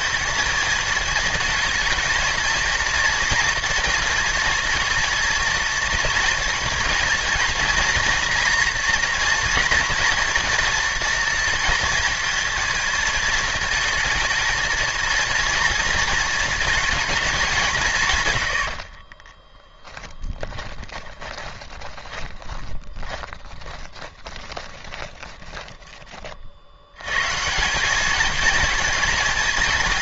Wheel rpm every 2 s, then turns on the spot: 220, 230, 240, 230, 240, 230, 230, 230, 220, 70, 20, 30, 20, 60, 220.
18-26